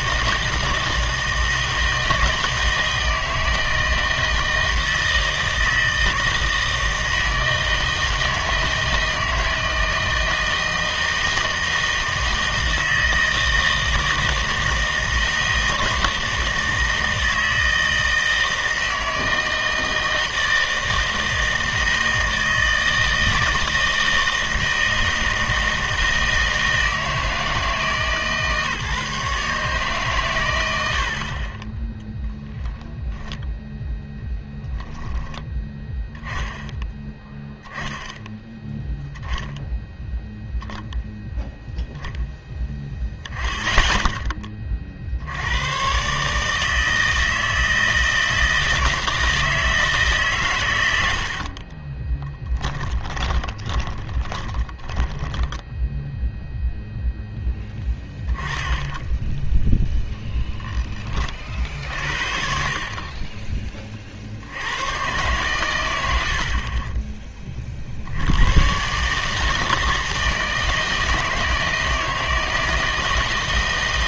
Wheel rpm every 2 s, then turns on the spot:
160, 160, 160, 160, 160, 160, 160, 160, 160, 160, 160, 160, 160, 160, 150, 100, 10, 10, 10, 10, 0, 10, 30, 160, 160, 120, 10, 20, 0, 10, 0, 50, 70, 50, 100, 160, 160.
52-56